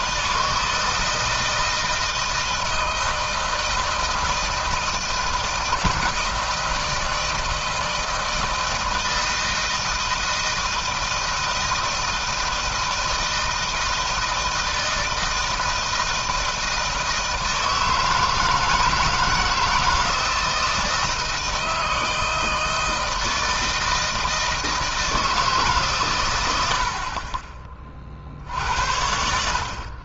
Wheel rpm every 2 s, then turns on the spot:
160, 160, 160, 160, 160, 160, 160, 160, 160, 160, 160, 160, 160, 90, 60.
none